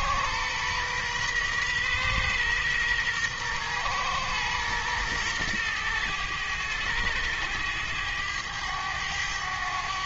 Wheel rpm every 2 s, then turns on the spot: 120, 120, 120, 100, 100.
none